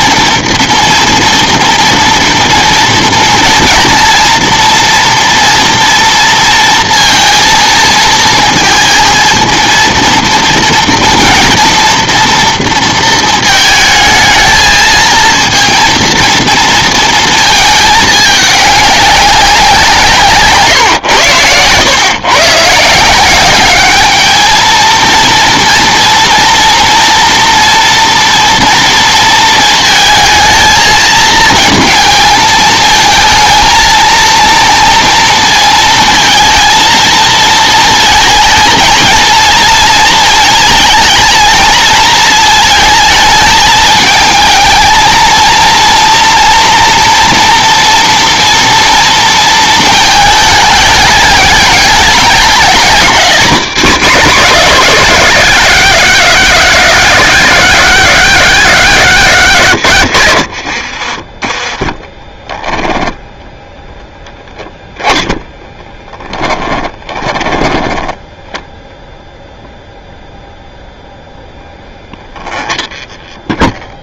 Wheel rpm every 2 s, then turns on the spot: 230, 230, 230, 230, 230, 230, 230, 220, 230, 200, 140, 140, 220, 230, 230, 220, 220, 230, 230, 220, 220, 220, 220, 240, 230, 210, 220, 240, 230, 220, 90, 10, 10, 20, 0, 0, 20.
20-22 60-68 72-74